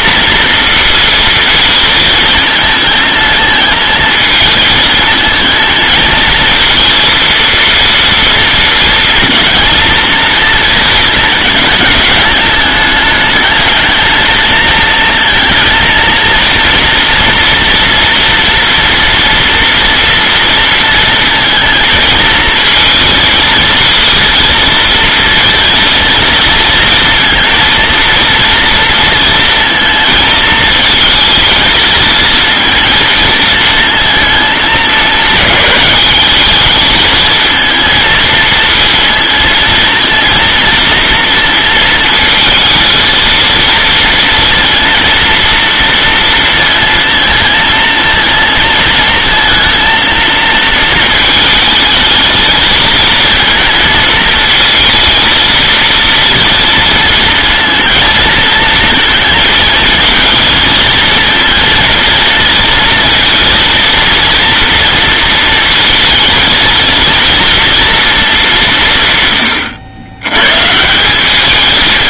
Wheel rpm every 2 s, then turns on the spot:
230, 220, 220, 230, 230, 230, 210, 220, 230, 230, 230, 220, 230, 230, 230, 230, 230, 210, 210, 230, 230, 220, 230, 230, 220, 230, 220, 220, 230, 230, 230, 230, 230, 230, 170, 150.
none